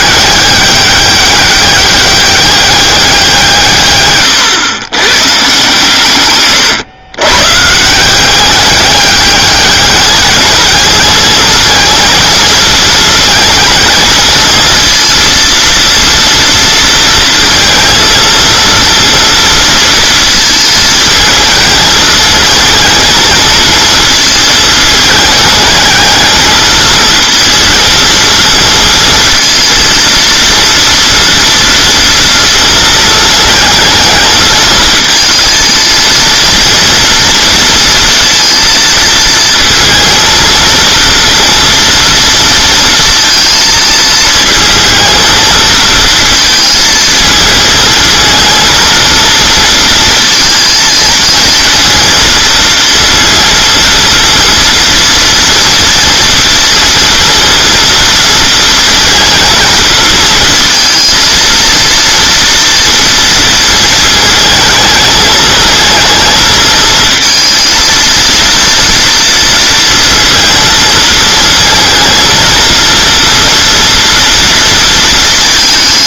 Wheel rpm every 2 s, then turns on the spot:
200, 200, 110, 130, 200, 220, 220, 230, 230, 230, 220, 230, 220, 220, 230, 230, 230, 220, 230, 230, 230, 230, 230, 220, 230, 230, 230, 230, 230, 220, 220, 230, 220, 220, 230, 220, 230, 230.
none